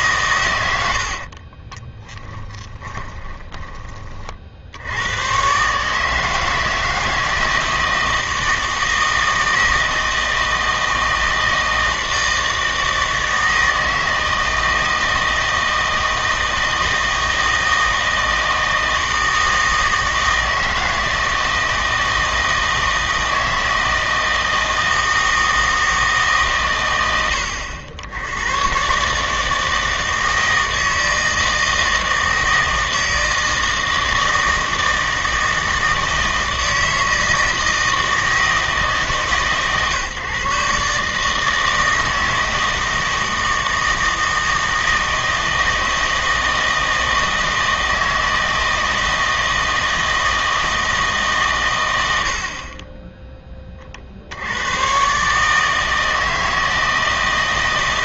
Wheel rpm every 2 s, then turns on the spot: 100, 20, 70, 160, 160, 160, 160, 160, 160, 160, 160, 160, 160, 120, 120, 160, 160, 160, 160, 160, 140, 160, 160, 160, 160, 160, 30, 110, 160.
2-4